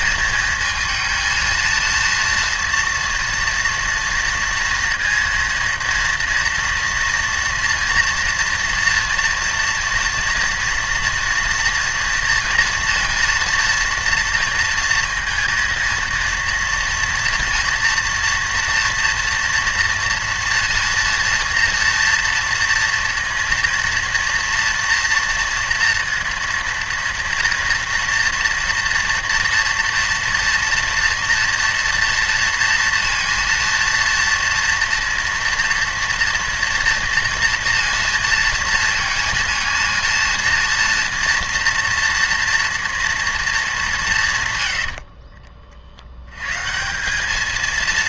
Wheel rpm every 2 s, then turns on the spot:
220, 230, 230, 230, 230, 230, 230, 230, 230, 240, 230, 230, 230, 230, 230, 230, 230, 230, 230, 230, 230, 230, 120, 140.
44-46